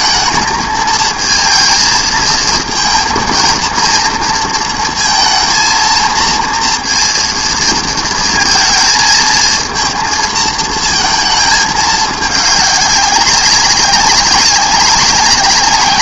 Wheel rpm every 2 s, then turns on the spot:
230, 230, 230, 230, 220, 220, 200, 190.
none